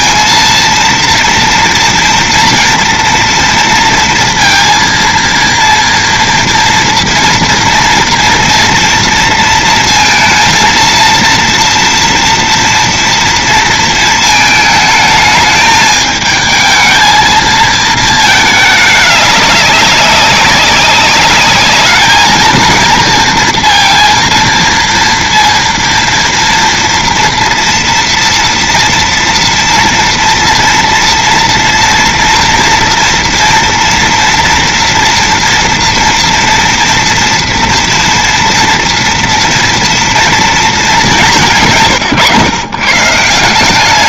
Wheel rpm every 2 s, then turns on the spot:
230, 230, 230, 230, 230, 230, 230, 220, 220, 210, 190, 230, 230, 230, 230, 230, 230, 230, 230, 230, 220, 140.
none